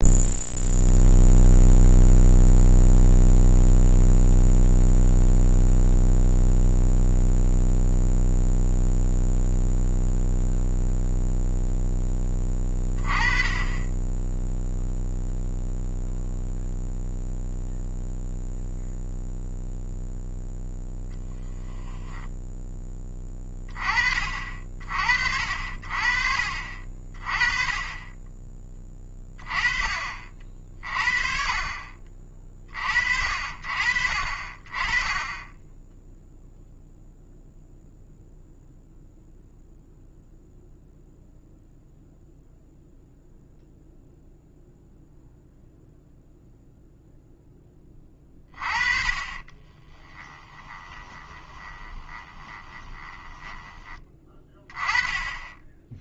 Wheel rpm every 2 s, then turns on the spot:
0, 0, 0, 0, 0, 0, 20, 0, 0, 0, 0, 10, 50, 40, 20, 40, 40, 30, 0, 0, 0, 0, 0, 0, 30, 20, 20, 20.
50-54